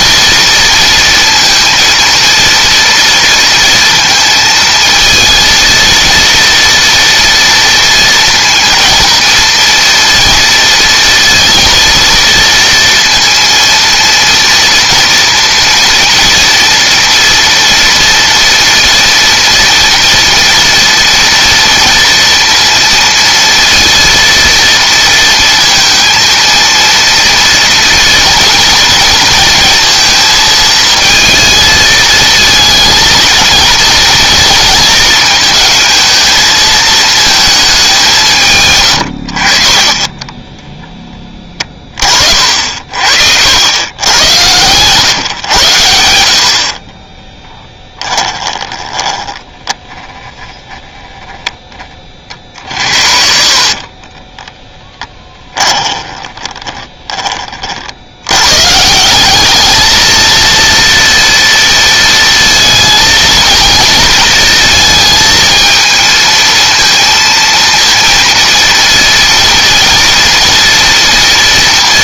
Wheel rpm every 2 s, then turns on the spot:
230, 230, 230, 230, 230, 230, 230, 230, 240, 230, 230, 230, 230, 230, 230, 230, 220, 220, 220, 110, 20, 60, 110, 30, 20, 10, 50, 10, 20, 160, 230, 230, 220, 230, 230, 230.
46-50 52-58